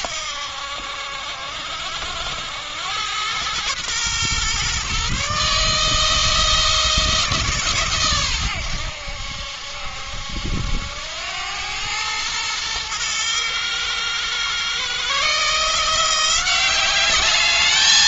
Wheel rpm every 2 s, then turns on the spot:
80, 90, 130, 160, 100, 80, 110, 130, 190.
none